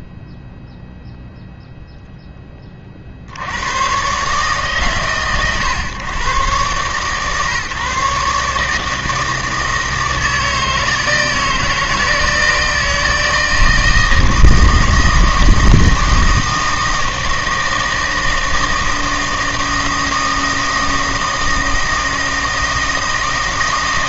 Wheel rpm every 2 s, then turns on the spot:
0, 30, 140, 130, 150, 160, 160, 160, 160, 160, 160, 160.
none